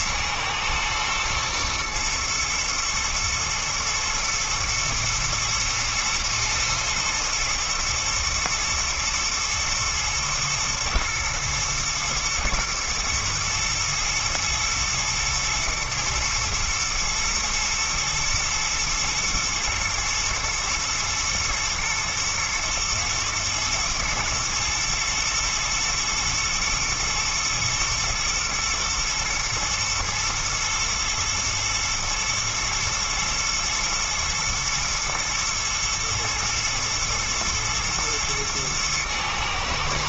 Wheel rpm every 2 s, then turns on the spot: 110, 110, 120, 110, 120, 110, 110, 120, 110, 120, 120, 110, 110, 110, 120, 120, 120, 110, 120, 110.
none